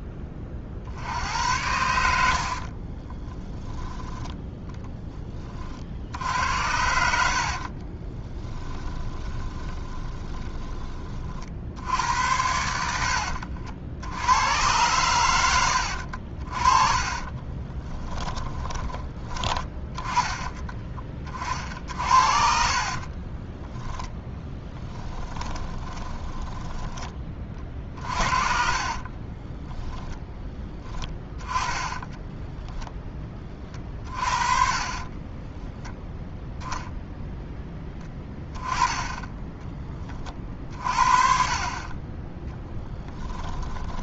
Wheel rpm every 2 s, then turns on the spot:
50, 60, 20, 80, 20, 20, 80, 110, 40, 20, 30, 40, 20, 10, 40, 20, 10, 30, 0, 20, 50, 10.
2-4 8-10 16-20 22-26 28-32 38-40 42-44